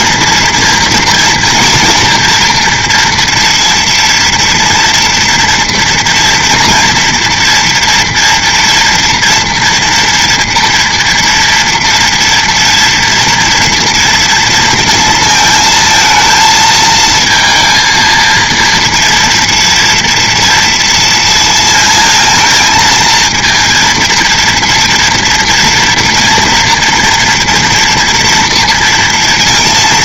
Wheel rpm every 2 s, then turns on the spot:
240, 230, 230, 230, 230, 230, 240, 230, 220, 230, 230, 220, 230, 230, 230.
none